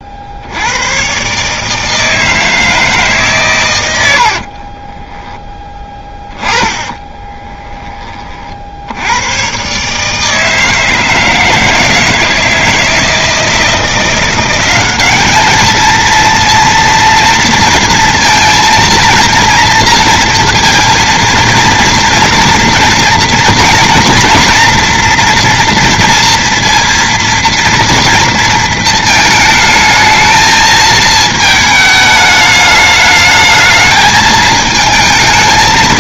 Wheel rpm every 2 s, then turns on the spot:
80, 160, 40, 10, 60, 160, 160, 190, 230, 230, 230, 230, 230, 230, 230, 220, 210, 220.
4-8